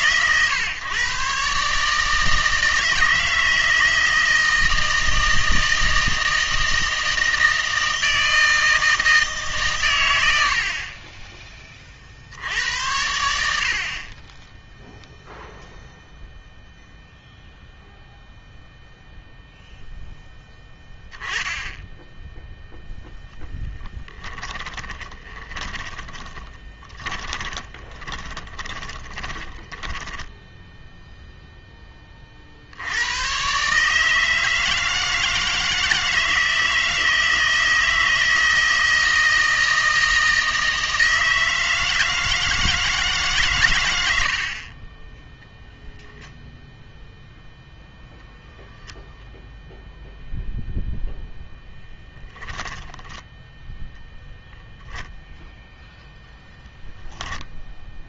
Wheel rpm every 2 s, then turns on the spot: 130, 160, 160, 160, 160, 50, 80, 0, 0, 0, 10, 0, 20, 30, 30, 0, 60, 160, 160, 160, 160, 160, 40, 0, 0, 0, 10, 10, 0.
24-30 52-56